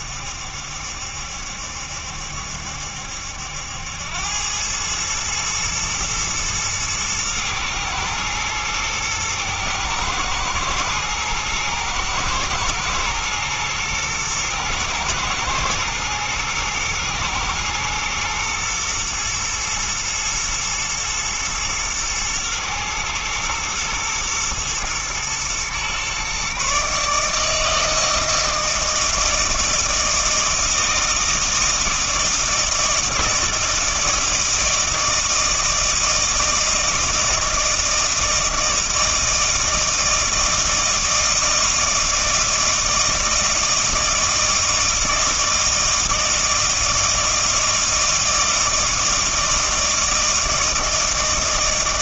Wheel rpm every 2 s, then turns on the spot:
70, 70, 100, 110, 110, 110, 110, 120, 110, 120, 110, 120, 120, 140, 160, 160, 160, 160, 160, 160, 160, 160, 160, 160, 160, 160.
none